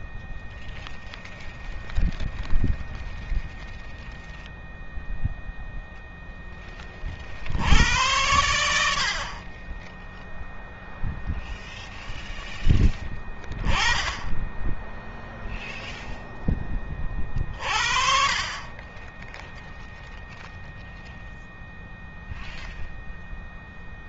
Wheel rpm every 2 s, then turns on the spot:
0, 0, 0, 10, 80, 0, 0, 0, 20, 30, 0, 0.
none